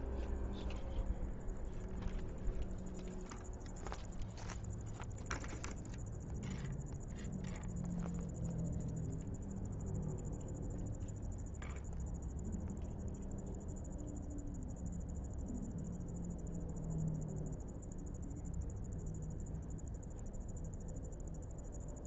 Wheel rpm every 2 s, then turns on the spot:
0, 0, 0, 0, 0, 0, 0, 0, 0, 0, 0.
none